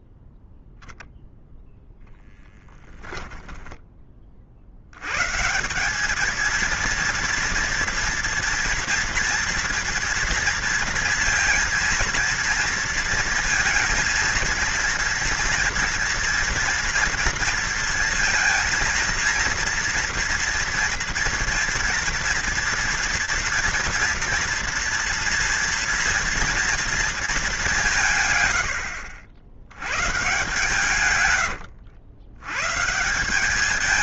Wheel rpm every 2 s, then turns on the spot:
0, 10, 80, 230, 230, 230, 230, 230, 230, 230, 230, 230, 230, 230, 80, 130, 150.
2-4 28-32